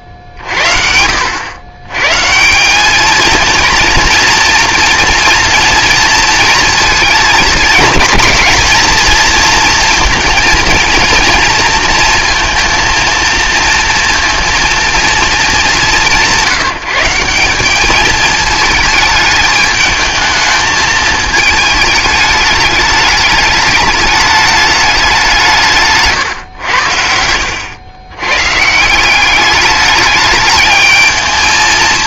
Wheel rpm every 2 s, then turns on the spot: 60, 220, 230, 220, 230, 230, 230, 230, 170, 210, 220, 210, 200, 80, 170, 220.
none